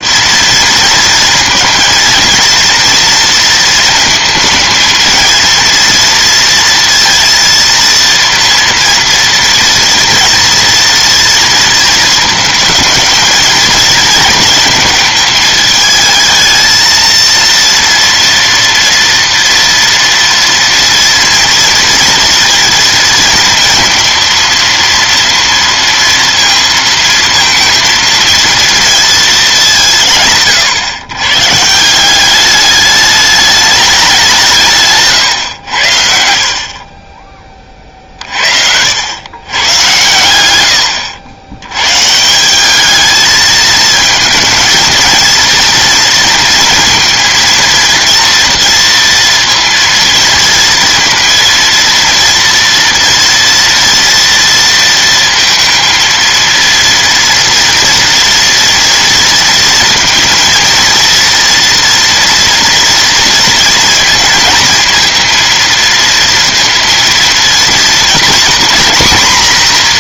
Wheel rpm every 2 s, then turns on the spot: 230, 230, 230, 230, 230, 230, 220, 220, 230, 230, 230, 230, 230, 230, 230, 120, 210, 150, 40, 90, 90, 210, 230, 230, 230, 230, 230, 230, 230, 230, 230, 230, 230, 230, 240.
none